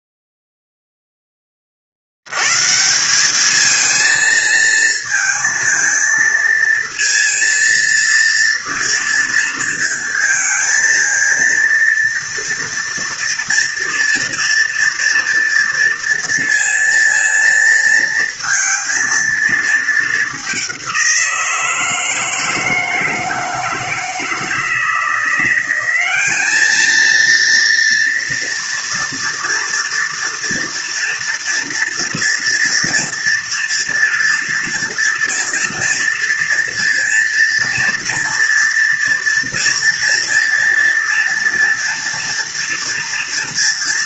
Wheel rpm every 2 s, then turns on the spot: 0, 120, 230, 230, 230, 220, 230, 230, 230, 230, 200, 160, 160, 210, 230, 230, 230, 230, 230, 230, 230, 230.
none